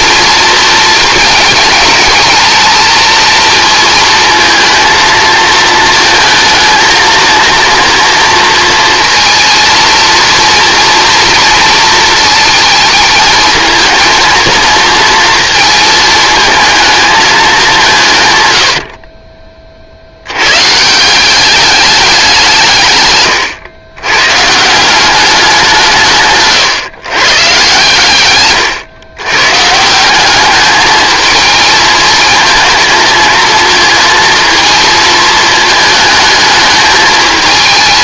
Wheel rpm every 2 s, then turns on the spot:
220, 220, 230, 220, 230, 230, 220, 230, 220, 90, 130, 160, 160, 140, 120, 210, 230, 230, 210.
28-30